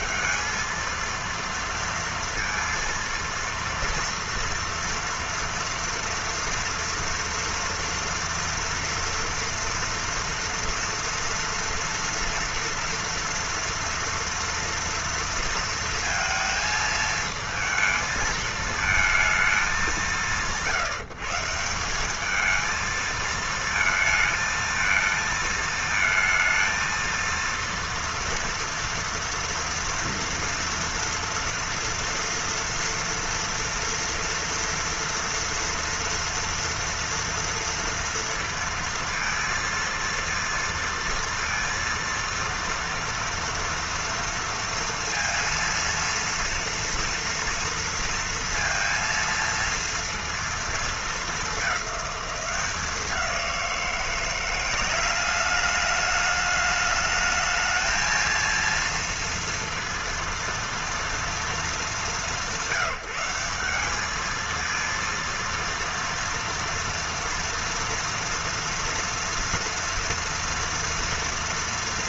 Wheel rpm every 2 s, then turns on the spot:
210, 230, 230, 240, 230, 230, 230, 230, 230, 220, 150, 210, 220, 230, 230, 230, 240, 230, 230, 230, 230, 230, 230, 230, 230, 230, 200, 180, 210, 230, 230, 190, 210, 230, 230, 230.
none